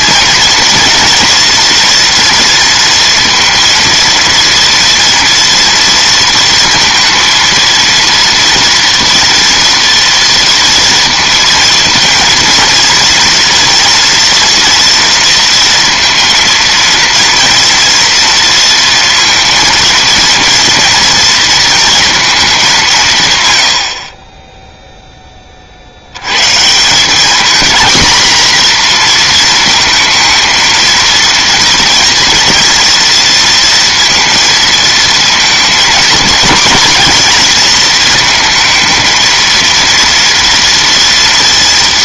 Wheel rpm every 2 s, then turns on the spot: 240, 230, 230, 230, 230, 230, 230, 230, 230, 230, 230, 180, 0, 170, 240, 230, 230, 220, 230, 220, 230.
none